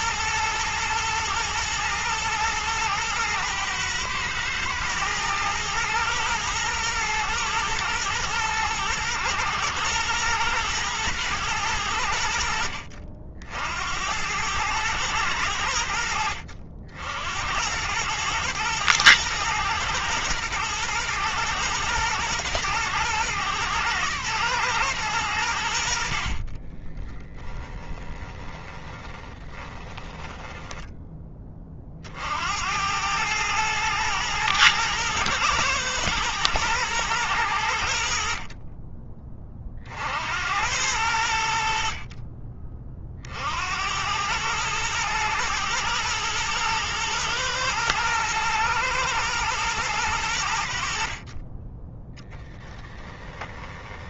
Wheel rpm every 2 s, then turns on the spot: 120, 110, 110, 110, 120, 110, 60, 100, 70, 110, 120, 110, 110, 20, 10, 10, 90, 110, 110, 30, 90, 50, 110, 110, 120, 70, 10.
26-30 52-54